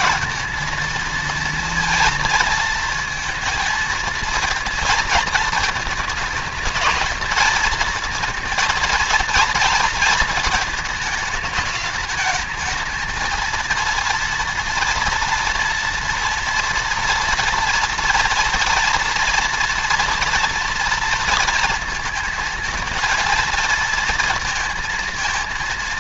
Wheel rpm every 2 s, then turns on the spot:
230, 230, 230, 220, 230, 220, 220, 230, 230, 230, 230, 230, 230.
none